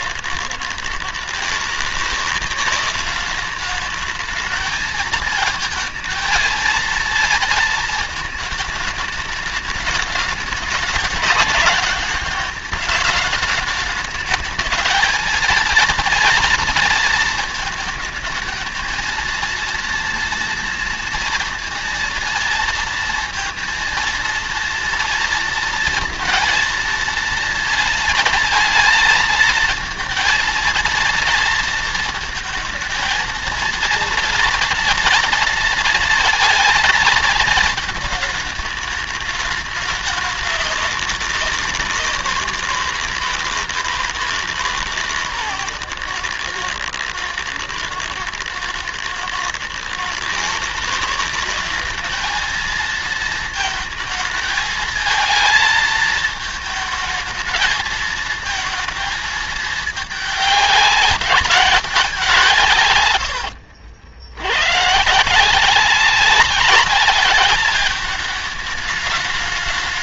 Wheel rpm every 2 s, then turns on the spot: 120, 180, 220, 230, 220, 210, 210, 220, 230, 230, 230, 230, 230, 230, 220, 230, 220, 230, 220, 220, 200, 180, 150, 120, 110, 150, 220, 220, 220, 220, 200, 150, 100, 200, 210.
none